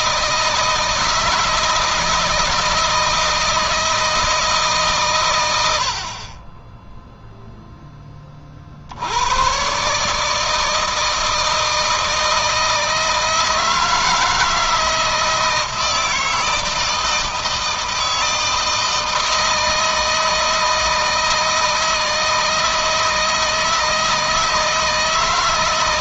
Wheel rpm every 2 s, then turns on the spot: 160, 160, 140, 10, 70, 160, 160, 160, 160, 160, 160, 160, 160.
none